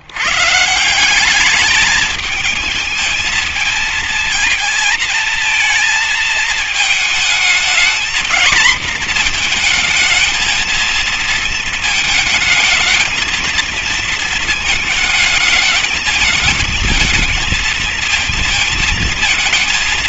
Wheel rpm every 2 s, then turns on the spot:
140, 220, 230, 220, 230, 220, 210, 230, 220, 220.
none